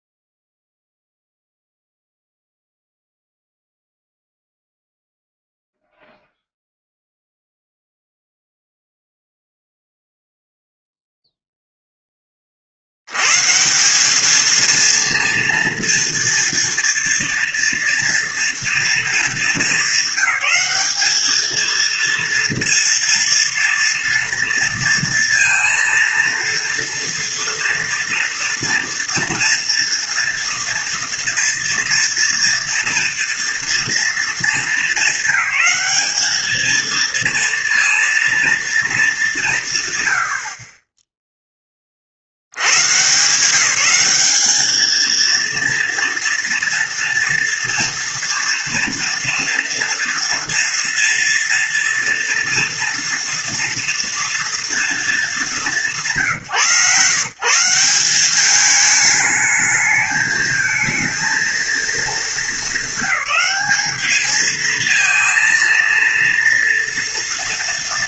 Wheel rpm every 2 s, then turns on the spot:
0, 0, 0, 0, 0, 0, 40, 230, 230, 230, 200, 230, 230, 230, 240, 230, 230, 230, 220, 230, 50, 80, 210, 230, 230, 230, 230, 230, 140, 200, 220, 220, 220, 230.
none